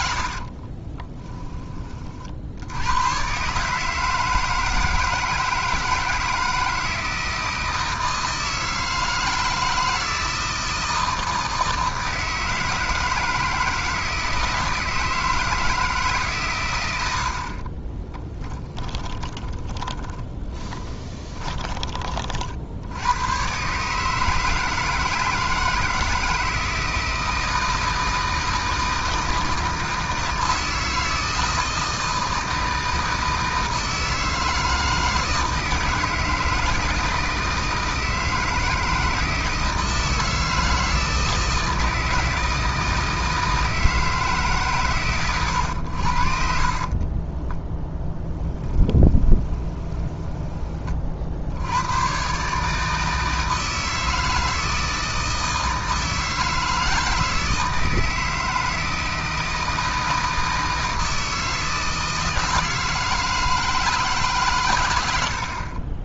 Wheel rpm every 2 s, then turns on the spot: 30, 90, 160, 160, 160, 160, 160, 160, 110, 20, 20, 80, 160, 160, 160, 160, 160, 160, 160, 160, 160, 160, 130, 40, 10, 30, 160, 160, 160, 160, 160, 160, 100.
0-2 18-22 46-50